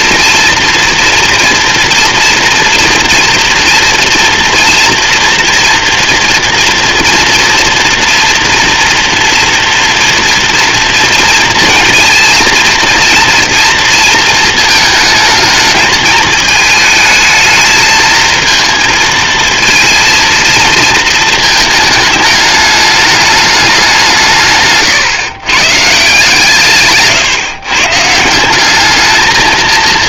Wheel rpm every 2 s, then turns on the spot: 230, 230, 240, 230, 240, 230, 230, 220, 220, 230, 220, 210, 150, 130, 220.
none